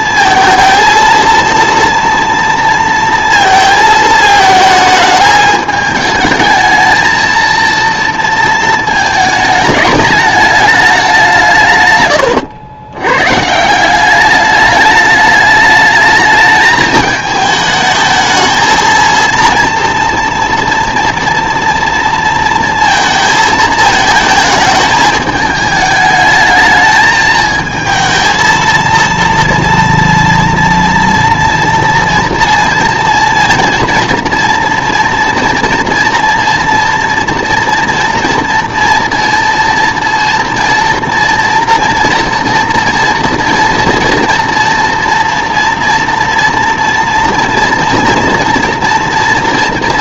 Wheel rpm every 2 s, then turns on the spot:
230, 230, 220, 220, 220, 200, 100, 210, 210, 230, 230, 230, 220, 220, 230, 230, 230, 230, 230, 230, 240, 230, 230, 230, 230.
none